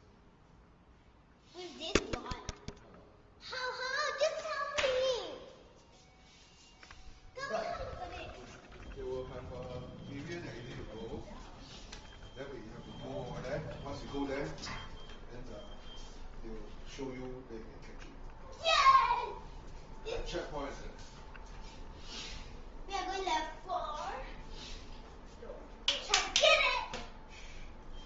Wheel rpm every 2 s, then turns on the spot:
0, 0, 0, 0, 0, 0, 0, 0, 0, 0, 0, 0, 0, 0.
none